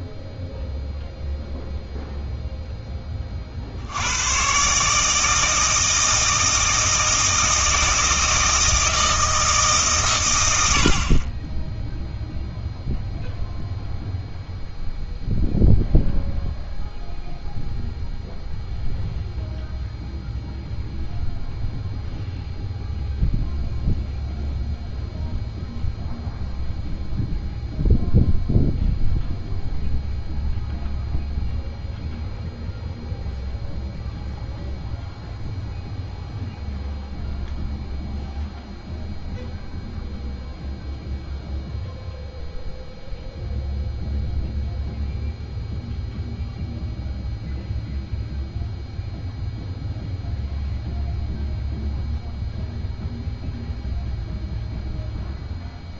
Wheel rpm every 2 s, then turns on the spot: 0, 0, 130, 160, 160, 70, 0, 0, 0, 0, 0, 0, 0, 0, 0, 0, 0, 0, 0, 0, 0, 0, 0, 0, 0, 0, 0, 0.
none